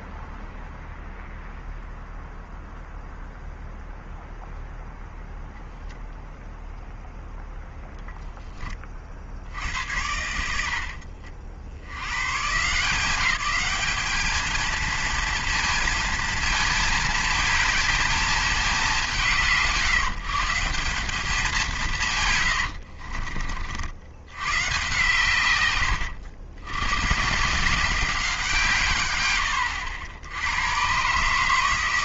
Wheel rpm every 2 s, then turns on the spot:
0, 0, 0, 0, 20, 70, 160, 230, 220, 210, 180, 70, 130, 110, 140, 120.
22-24